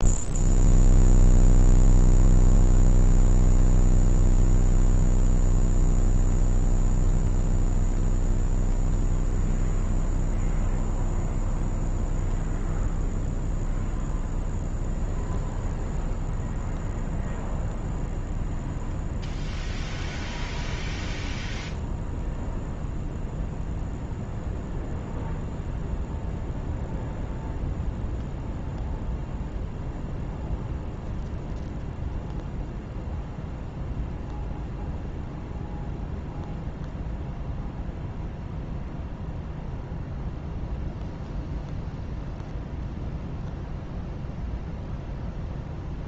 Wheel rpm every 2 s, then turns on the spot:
0, 0, 0, 0, 0, 0, 0, 0, 0, 0, 0, 0, 0, 0, 0, 0, 0, 0, 0, 0, 0, 0, 0.
none